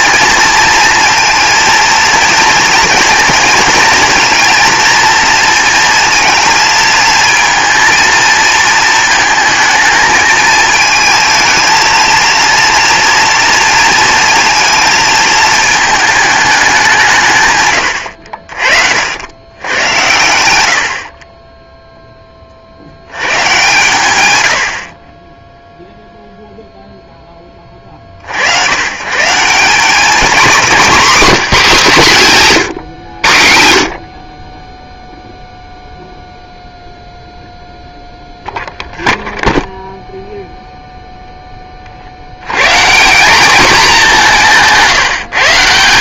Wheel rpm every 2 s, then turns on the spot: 230, 230, 240, 220, 220, 220, 230, 230, 190, 60, 70, 90, 50, 0, 110, 240, 130, 0, 0, 0, 0, 160, 160.
none